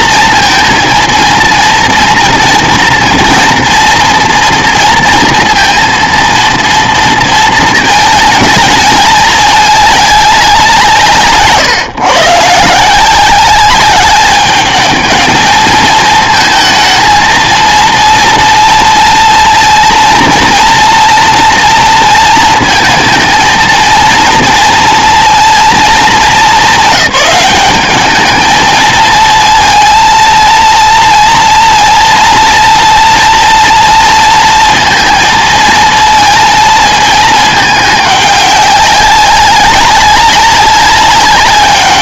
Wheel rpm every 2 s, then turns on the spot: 230, 230, 230, 230, 210, 170, 160, 210, 220, 230, 230, 220, 230, 200, 220, 230, 240, 230, 220, 190, 200.
none